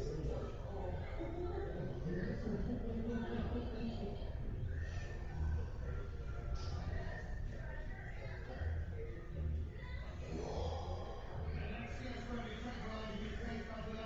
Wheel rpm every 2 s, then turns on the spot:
0, 0, 0, 0, 0, 0, 0.
none